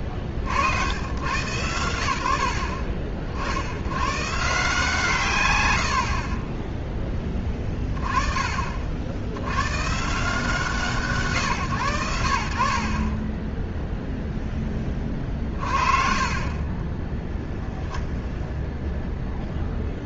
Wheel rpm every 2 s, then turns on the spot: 90, 50, 160, 10, 70, 150, 30, 30, 10, 0.
none